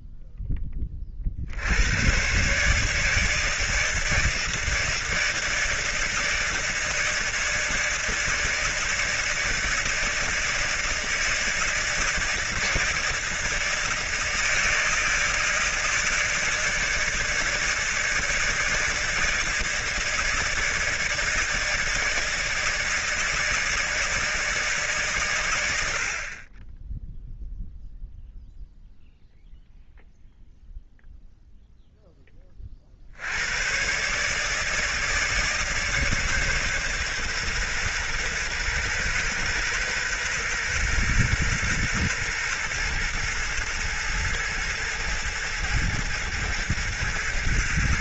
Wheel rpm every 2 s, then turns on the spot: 10, 140, 160, 160, 160, 160, 160, 160, 160, 160, 160, 160, 160, 40, 0, 0, 20, 150, 140, 130, 130, 120, 110, 110.
none